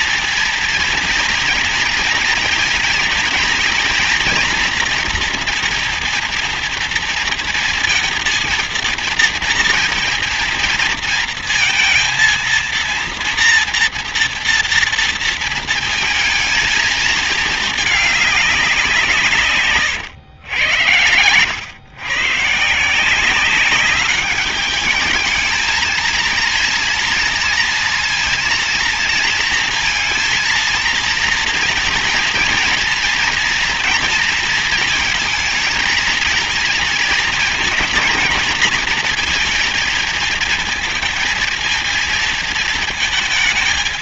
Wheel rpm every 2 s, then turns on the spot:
230, 230, 230, 230, 230, 230, 230, 230, 210, 150, 100, 190, 220, 230, 230, 230, 230, 220, 230, 230, 230, 210.
none